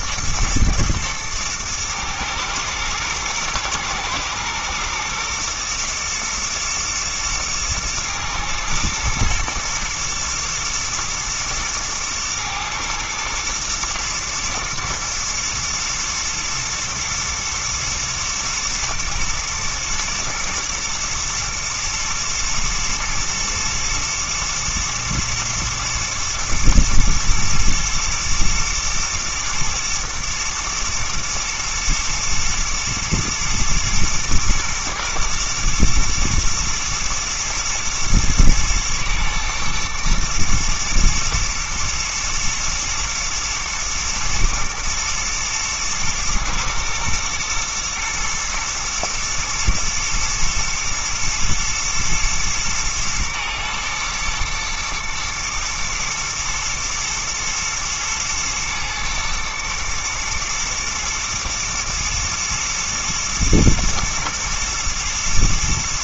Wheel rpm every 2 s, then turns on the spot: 110, 120, 110, 120, 120, 110, 110, 110, 110, 110, 110, 110, 110, 120, 120, 120, 120, 110, 110, 110, 120, 120, 110, 110, 120, 120, 110, 120, 110, 120, 120, 120, 110.
none